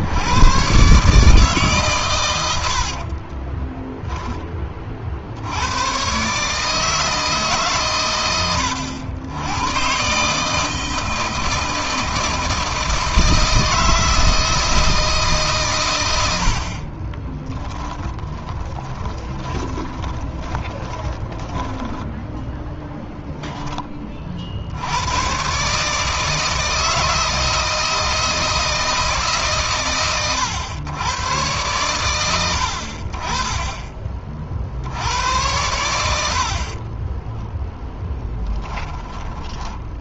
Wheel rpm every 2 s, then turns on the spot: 130, 80, 30, 130, 100, 150, 160, 160, 50, 20, 30, 10, 70, 160, 160, 110, 90, 50, 20, 10.
2-4 16-24 36-40